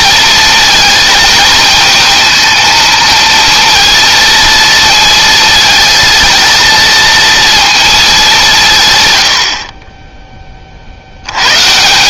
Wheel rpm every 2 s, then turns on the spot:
220, 230, 230, 230, 110, 70.
none